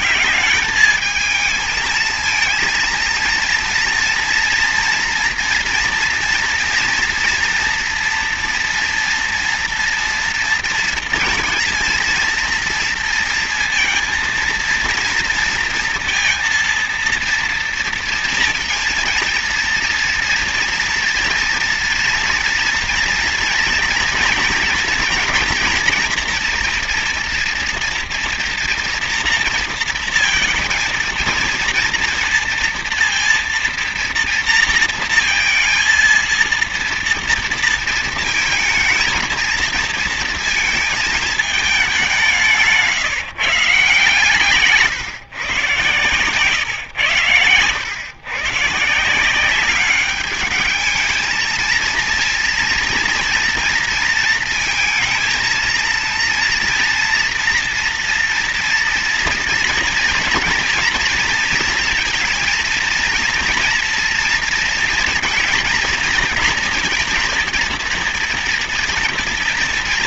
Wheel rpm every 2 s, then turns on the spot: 180, 230, 230, 230, 230, 230, 230, 230, 230, 230, 230, 230, 240, 230, 240, 230, 230, 230, 230, 220, 230, 190, 150, 110, 130, 210, 230, 230, 230, 230, 240, 230, 230, 220, 230.
none